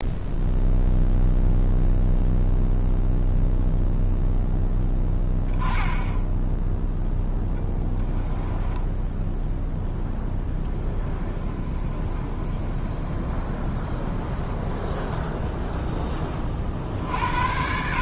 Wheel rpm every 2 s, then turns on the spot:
0, 0, 10, 0, 10, 20, 20, 10, 40.
8-16